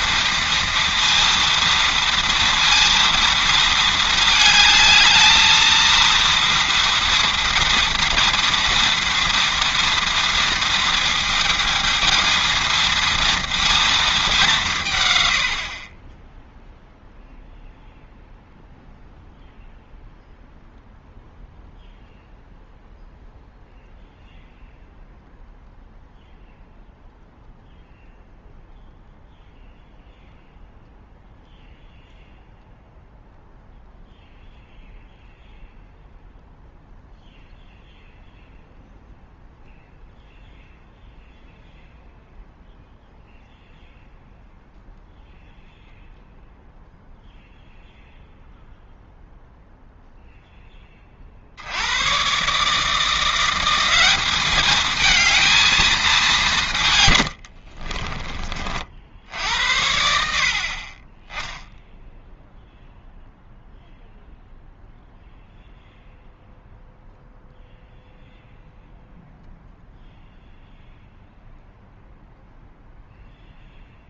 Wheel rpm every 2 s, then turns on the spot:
230, 230, 220, 230, 230, 230, 230, 160, 0, 0, 0, 0, 0, 0, 0, 0, 0, 0, 0, 0, 0, 0, 0, 0, 0, 20, 150, 220, 140, 50, 40, 0, 0, 0, 0, 0, 0.
none